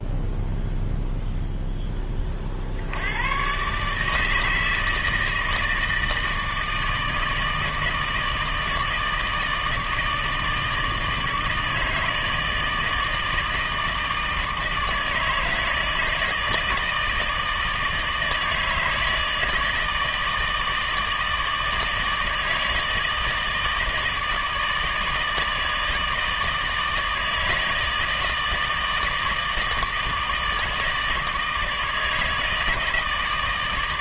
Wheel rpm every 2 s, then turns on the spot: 0, 60, 160, 160, 160, 160, 160, 160, 160, 160, 160, 160, 160, 160, 160, 160, 160.
none